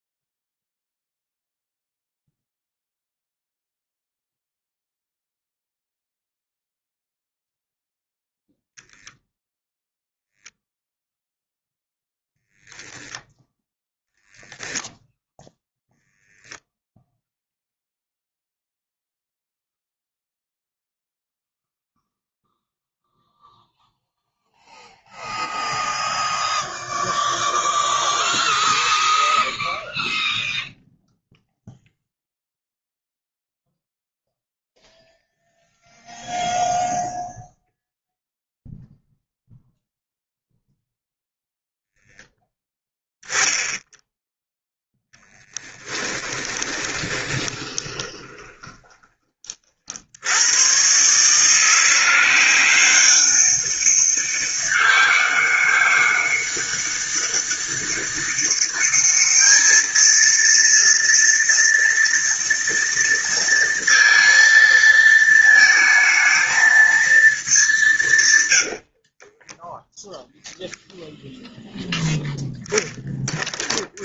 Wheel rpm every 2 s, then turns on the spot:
0, 0, 0, 0, 0, 0, 0, 0, 10, 0, 0, 0, 0, 0, 0, 0, 0, 0, 0, 0, 0, 0, 10, 20, 20, 120, 190, 200, 200, 210, 230, 230, 230, 220, 80, 0, 0.
46-50 68-70